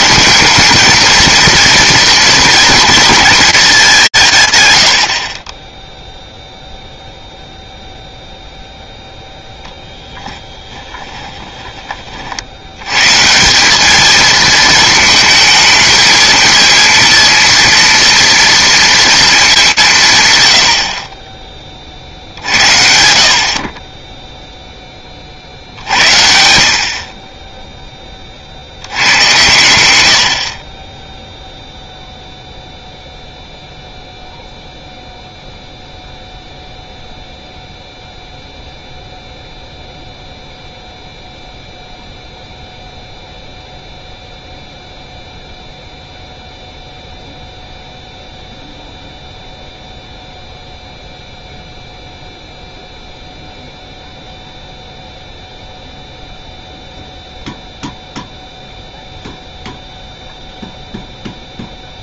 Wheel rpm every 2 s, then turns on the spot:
220, 230, 100, 0, 0, 10, 90, 220, 230, 230, 100, 70, 10, 60, 80, 20, 0, 0, 0, 0, 0, 0, 0, 0, 0, 0, 0, 0, 0, 0, 0.
10-12